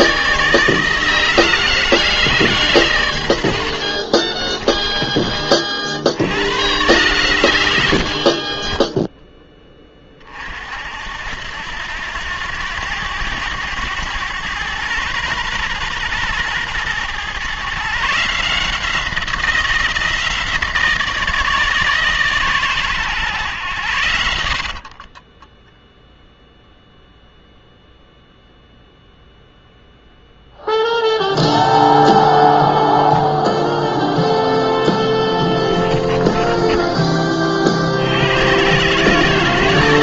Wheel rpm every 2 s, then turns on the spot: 160, 120, 30, 120, 20, 60, 100, 120, 120, 170, 160, 120, 40, 0, 0, 0, 0, 10, 30, 110.
8-10 24-26 34-36